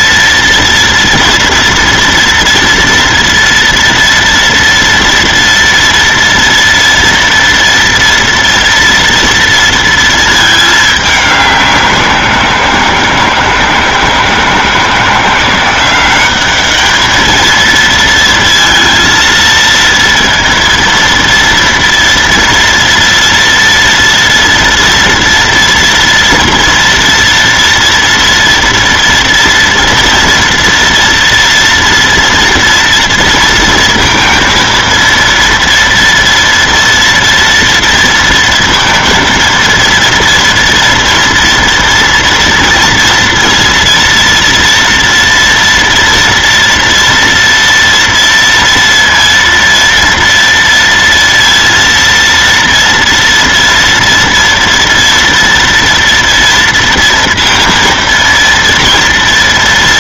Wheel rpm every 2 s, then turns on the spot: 230, 230, 230, 230, 240, 220, 170, 160, 210, 230, 230, 230, 230, 230, 230, 230, 230, 230, 230, 230, 230, 230, 230, 230, 230, 230, 230, 230, 230, 230.
none